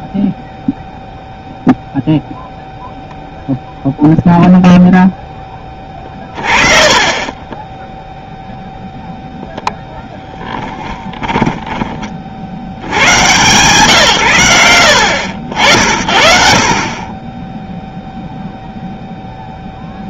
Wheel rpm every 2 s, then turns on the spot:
0, 0, 0, 30, 0, 20, 90, 90, 40, 0.
6-8 10-12